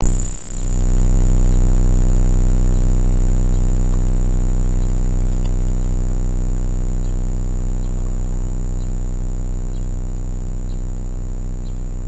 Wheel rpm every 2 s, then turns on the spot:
0, 0, 0, 0, 0, 0.
none